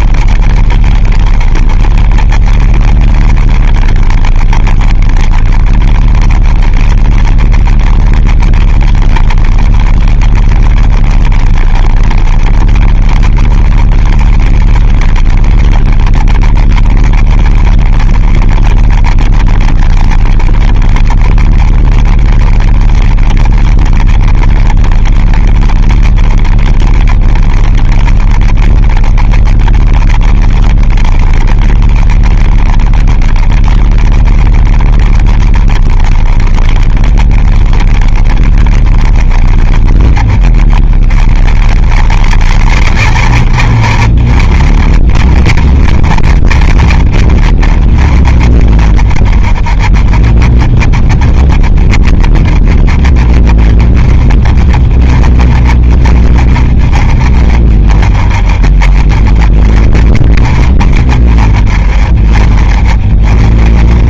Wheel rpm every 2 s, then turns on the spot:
30, 30, 30, 30, 30, 30, 30, 30, 40, 30, 30, 30, 30, 30, 30, 30, 30, 30, 30, 30, 30, 50, 40, 40, 30, 30, 30, 30, 30, 30, 30, 30.
none